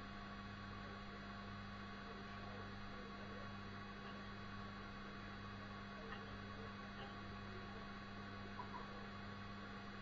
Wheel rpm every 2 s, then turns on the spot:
0, 0, 0, 0, 0.
none